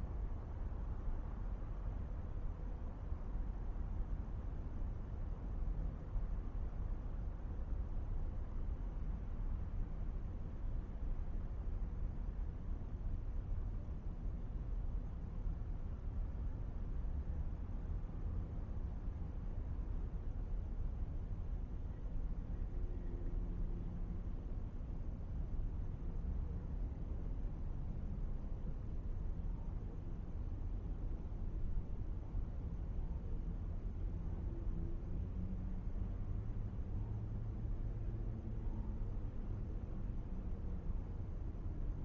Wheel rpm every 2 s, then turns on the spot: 0, 0, 0, 0, 0, 0, 0, 0, 0, 0, 0, 0, 0, 0, 0, 0, 0, 0, 0, 0, 0.
none